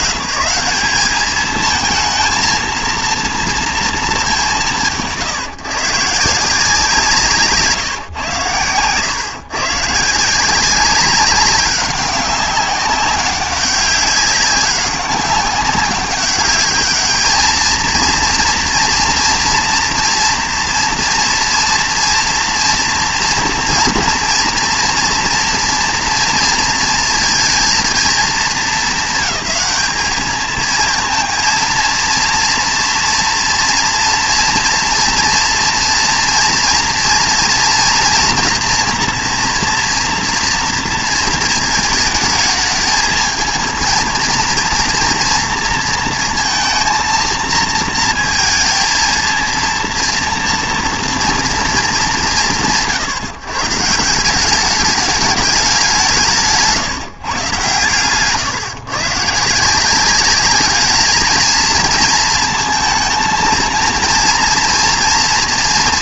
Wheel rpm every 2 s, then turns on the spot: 180, 230, 180, 170, 130, 180, 200, 200, 210, 230, 230, 230, 230, 230, 200, 220, 230, 240, 230, 240, 230, 220, 230, 230, 230, 230, 170, 190, 170, 150, 210, 230, 230.
none